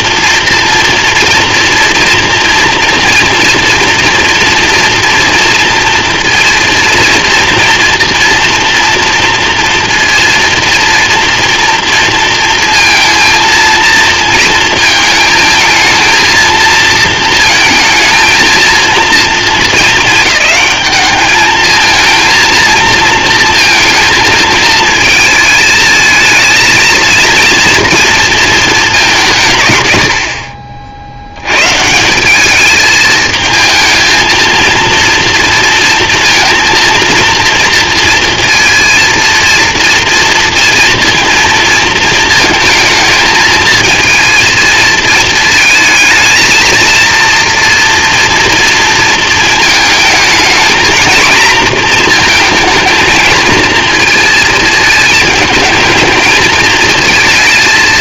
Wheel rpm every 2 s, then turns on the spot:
240, 230, 240, 230, 230, 230, 230, 230, 230, 230, 210, 220, 220, 230, 210, 60, 220, 230, 230, 230, 230, 220, 220, 230, 230, 220, 230, 220, 220.
none